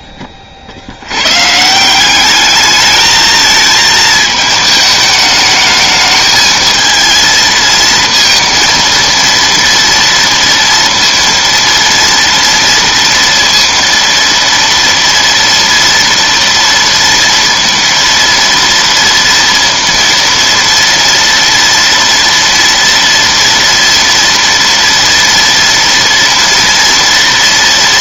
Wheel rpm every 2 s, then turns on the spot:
70, 210, 210, 220, 230, 230, 230, 230, 230, 230, 230, 230, 230, 230.
none